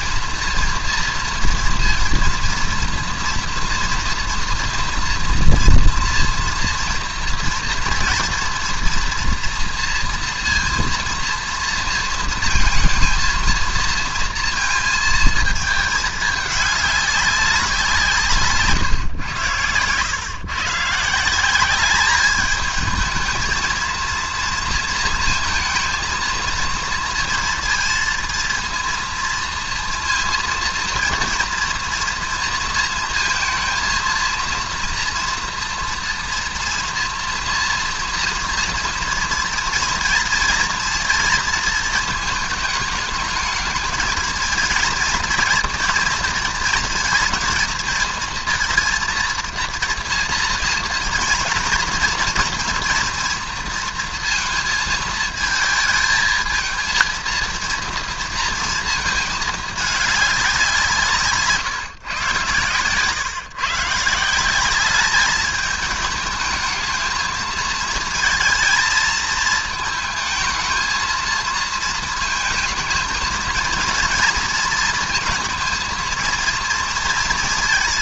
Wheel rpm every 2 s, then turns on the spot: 230, 230, 230, 230, 230, 230, 230, 230, 210, 150, 120, 210, 230, 230, 230, 230, 230, 230, 230, 230, 230, 220, 220, 230, 230, 230, 230, 230, 220, 230, 190, 130, 180, 220, 230, 220, 220, 230, 230.
62-64